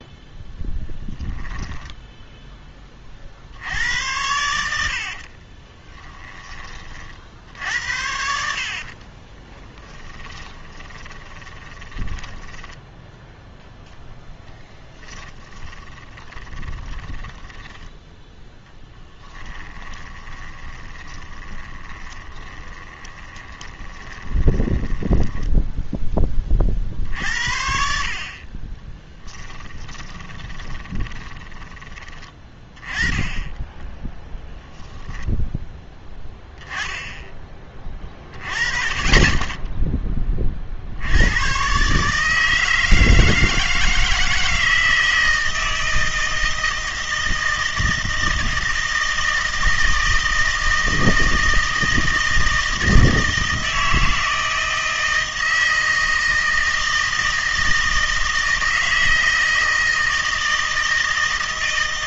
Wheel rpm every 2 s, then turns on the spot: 10, 10, 80, 30, 70, 30, 10, 20, 20, 10, 20, 20, 20, 40, 30, 20, 20, 0, 10, 30, 50, 160, 160, 160, 160, 160, 160, 160, 160, 160, 160.
0-2 4-6 8-18 20-26 30-32